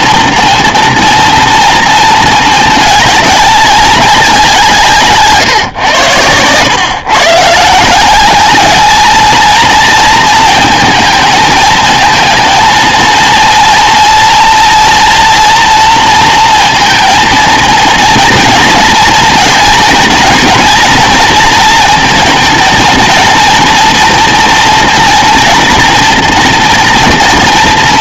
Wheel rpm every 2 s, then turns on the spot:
230, 210, 160, 120, 220, 220, 230, 230, 230, 230, 230, 220, 230, 230.
none